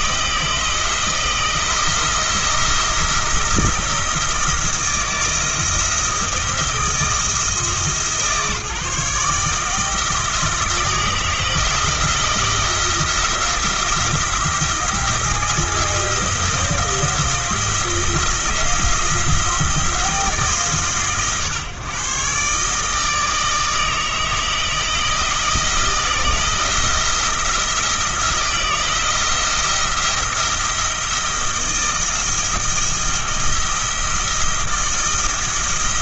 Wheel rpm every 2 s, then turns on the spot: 160, 170, 160, 160, 150, 160, 170, 170, 170, 170, 140, 150, 160, 170, 170, 170, 170, 160.
none